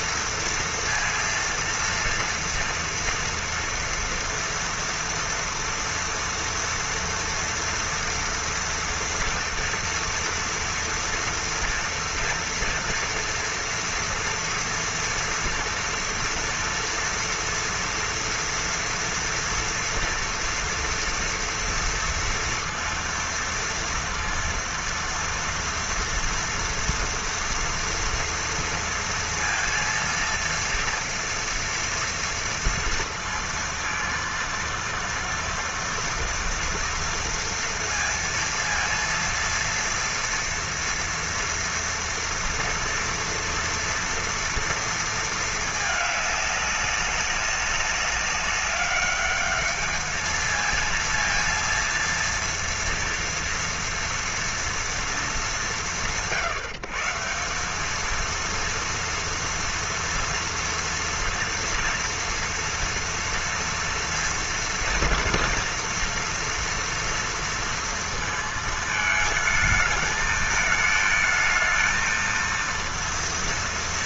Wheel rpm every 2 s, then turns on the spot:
230, 230, 230, 230, 240, 230, 230, 230, 240, 230, 230, 230, 230, 230, 230, 230, 230, 230, 230, 230, 230, 230, 230, 200, 200, 220, 230, 230, 140, 230, 230, 230, 230, 230, 220, 220, 230.
none